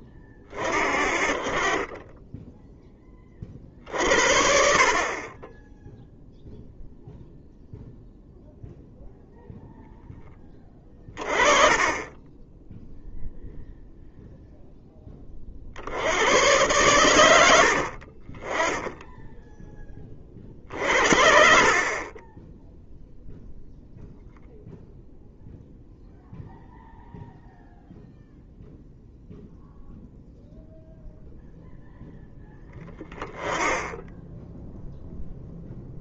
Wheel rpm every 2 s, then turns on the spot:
40, 20, 50, 0, 0, 30, 0, 10, 110, 10, 60, 0, 0, 0, 0, 0, 10, 0.
none